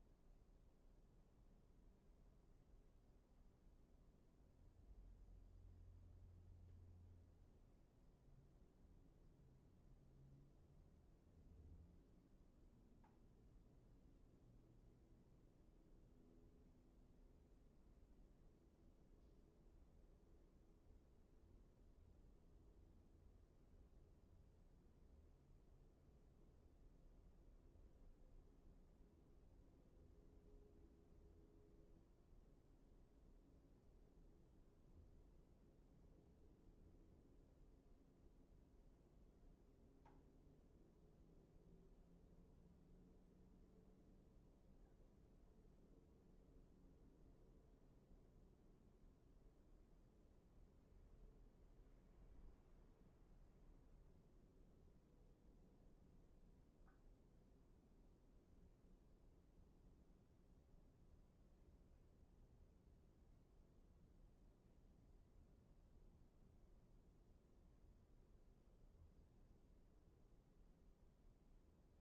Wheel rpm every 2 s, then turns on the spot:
0, 0, 0, 0, 0, 0, 0, 0, 0, 0, 0, 0, 0, 0, 0, 0, 0, 0, 0, 0, 0, 0, 0, 0, 0, 0, 0, 0, 0, 0, 0, 0, 0, 0, 0, 0.
none